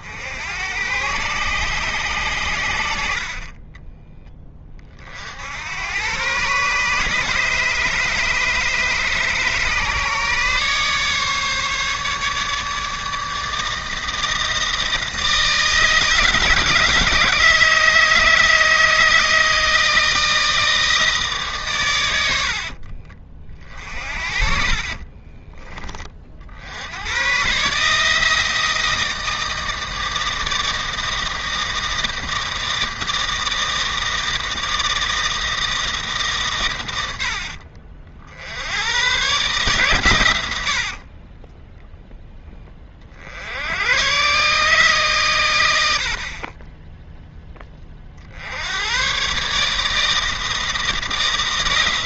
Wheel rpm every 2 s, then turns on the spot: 90, 90, 30, 140, 150, 140, 150, 160, 160, 160, 160, 70, 40, 70, 160, 160, 160, 160, 130, 80, 80, 20, 140, 20, 80, 160.
22-26 40-42